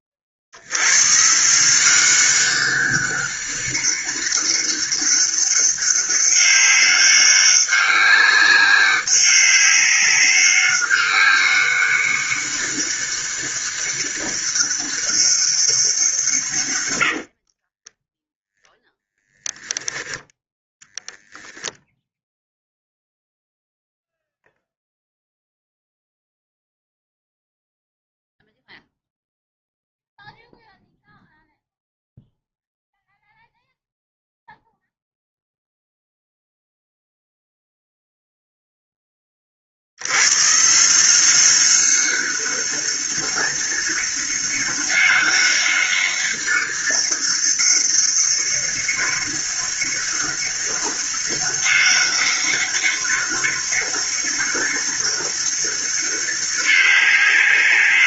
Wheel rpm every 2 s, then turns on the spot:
40, 190, 200, 200, 200, 200, 200, 200, 130, 0, 10, 0, 0, 0, 0, 0, 0, 0, 0, 0, 140, 190, 200, 200, 200, 200, 200, 200, 200.
none